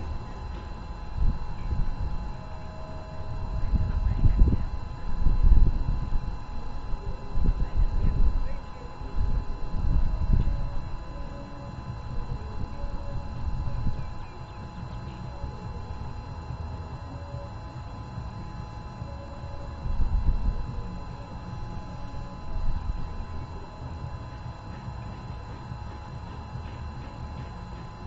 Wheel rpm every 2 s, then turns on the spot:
0, 0, 0, 0, 0, 0, 0, 0, 0, 0, 0, 0, 0, 0.
none